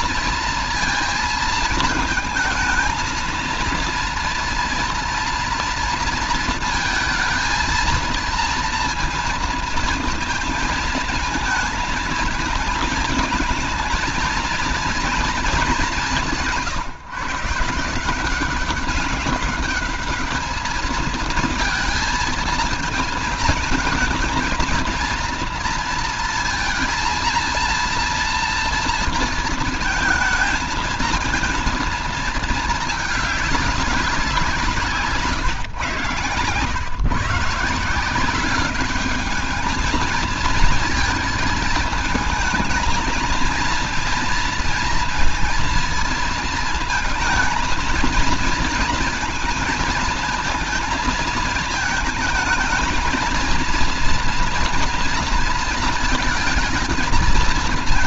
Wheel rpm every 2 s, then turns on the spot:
230, 220, 230, 230, 230, 230, 220, 230, 170, 180, 210, 220, 220, 220, 230, 220, 220, 180, 120, 190, 230, 220, 230, 230, 230, 220, 220, 230, 220.
none